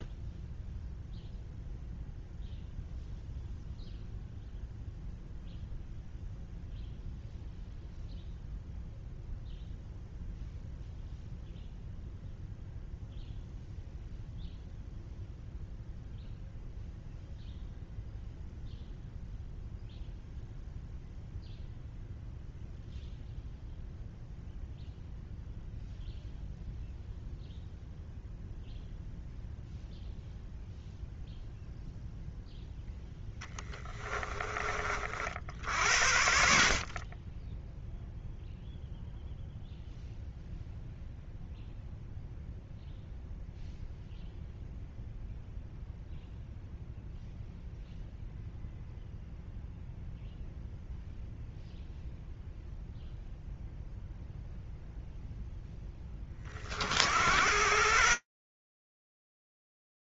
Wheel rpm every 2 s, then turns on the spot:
0, 0, 0, 0, 0, 0, 0, 0, 0, 0, 0, 0, 0, 0, 0, 0, 0, 30, 40, 0, 0, 0, 0, 0, 0, 0, 0, 0, 40, 10.
none